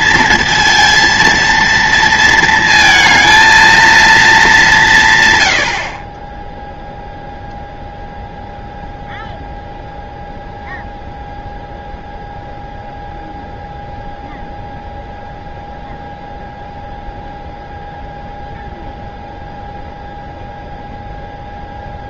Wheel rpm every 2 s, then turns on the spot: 230, 230, 190, 10, 0, 0, 0, 0, 0, 0, 0.
none